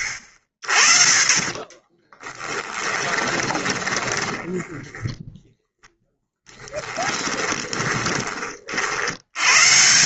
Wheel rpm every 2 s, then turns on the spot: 40, 20, 10, 20, 120.
2-4 6-8